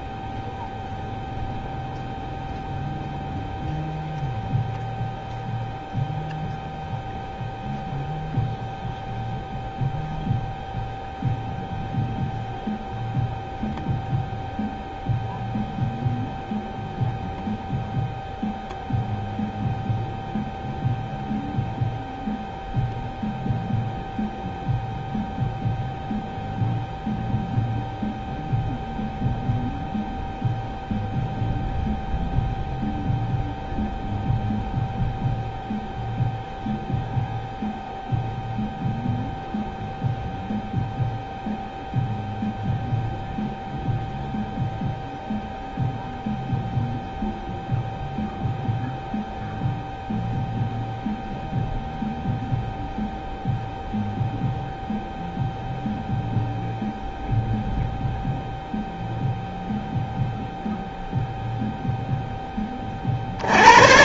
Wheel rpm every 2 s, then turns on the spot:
0, 0, 0, 0, 0, 0, 0, 0, 0, 0, 0, 0, 0, 0, 0, 0, 0, 0, 0, 0, 0, 0, 0, 0, 0, 0, 0, 0, 0, 0, 0, 10.
none